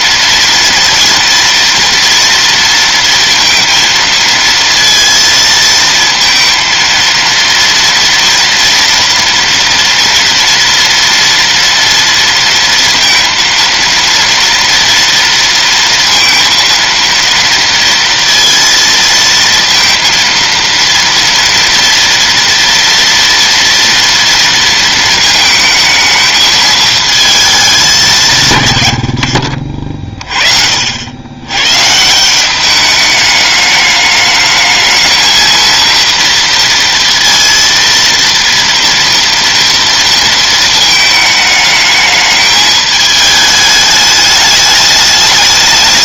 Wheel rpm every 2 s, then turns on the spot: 230, 230, 230, 230, 230, 230, 230, 230, 230, 230, 230, 230, 230, 220, 130, 40, 190, 210, 230, 230, 220, 210, 210.
none